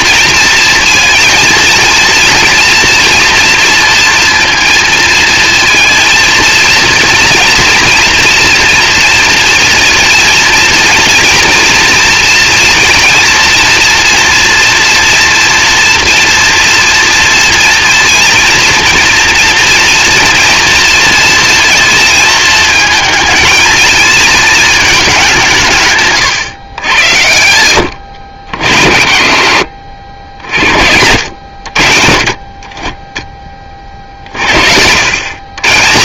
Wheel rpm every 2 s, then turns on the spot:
230, 240, 230, 230, 230, 230, 230, 230, 230, 230, 230, 220, 210, 100, 70, 80, 30, 80.
none